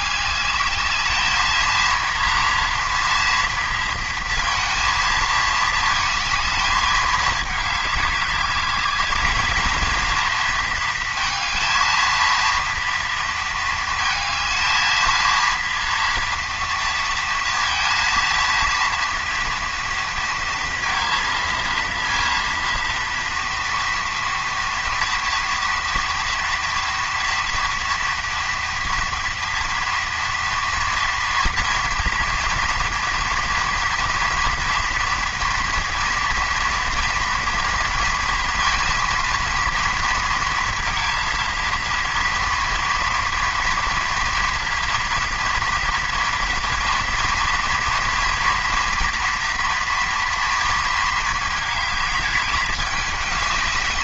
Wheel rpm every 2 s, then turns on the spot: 210, 230, 230, 220, 210, 230, 230, 220, 230, 230, 230, 230, 230, 230, 230, 230, 230, 240, 230, 230, 220, 230, 230, 230, 230, 230, 210.
none